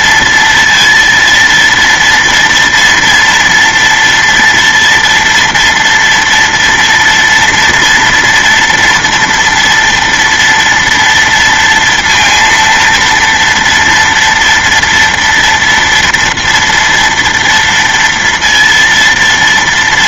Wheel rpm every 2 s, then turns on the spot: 230, 230, 240, 230, 240, 230, 230, 230, 230, 230.
none